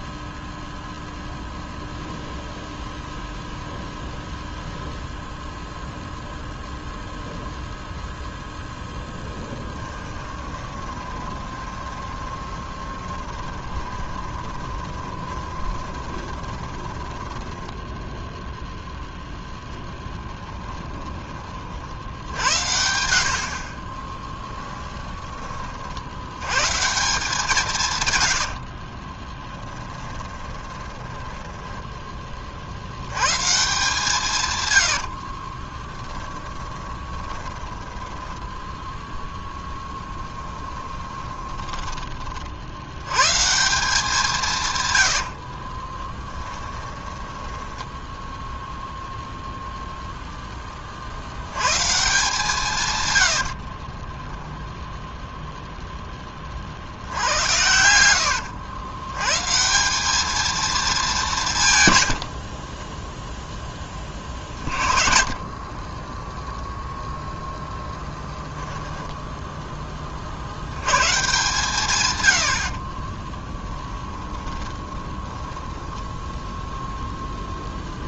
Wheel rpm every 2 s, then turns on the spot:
0, 0, 0, 0, 0, 20, 20, 20, 20, 0, 10, 80, 10, 110, 70, 20, 50, 110, 10, 10, 10, 60, 150, 10, 0, 10, 150, 10, 40, 90, 220, 50, 40, 0, 10, 70, 70, 20, 0.
10-18 20-22 24-26 28-32 34-42 46-48 62-64 68-70 74-76